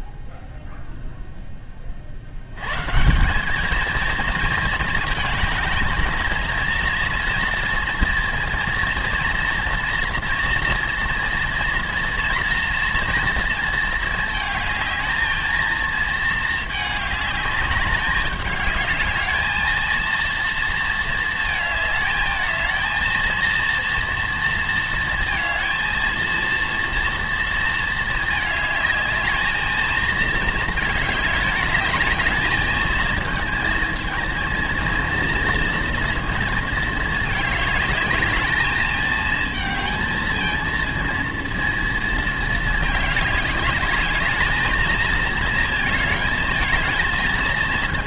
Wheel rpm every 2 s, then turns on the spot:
0, 170, 230, 230, 230, 240, 240, 220, 210, 210, 230, 230, 230, 230, 220, 210, 220, 230, 220, 220, 230, 210, 220, 220.
none